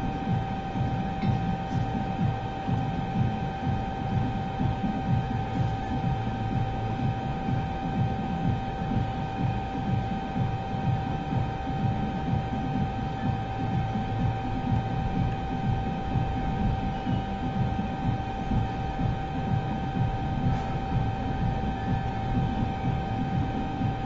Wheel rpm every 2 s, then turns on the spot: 0, 0, 0, 0, 0, 0, 0, 0, 0, 0, 0, 0.
none